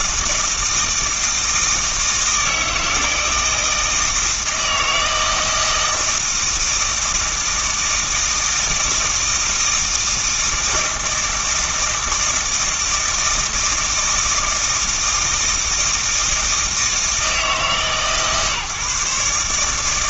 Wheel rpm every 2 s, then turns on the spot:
160, 160, 160, 160, 160, 160, 160, 160, 160, 140.
none